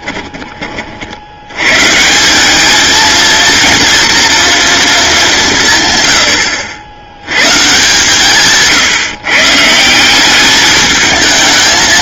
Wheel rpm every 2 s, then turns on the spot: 50, 220, 220, 80, 160, 210.
none